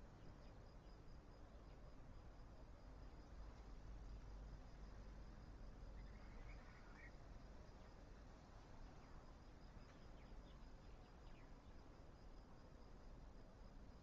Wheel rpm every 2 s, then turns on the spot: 0, 0, 0, 0, 0, 0, 0.
none